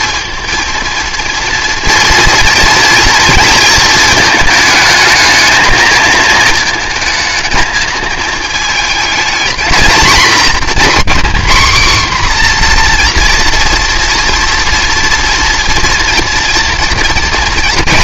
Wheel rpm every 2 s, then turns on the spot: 230, 230, 220, 220, 220, 260, 250, 230, 230.
none